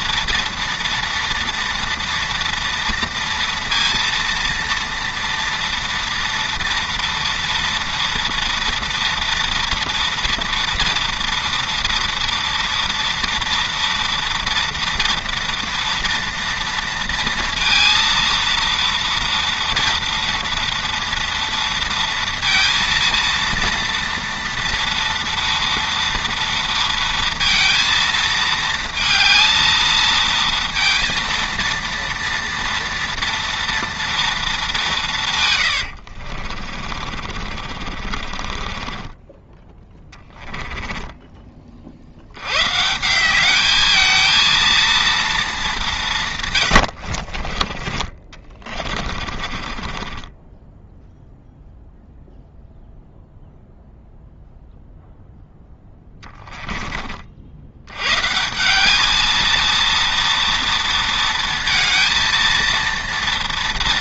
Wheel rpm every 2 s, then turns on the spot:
230, 230, 230, 230, 230, 230, 230, 230, 230, 230, 230, 230, 230, 230, 220, 230, 230, 190, 40, 20, 10, 140, 230, 110, 30, 10, 0, 0, 20, 200, 230, 230.
36-42 46-52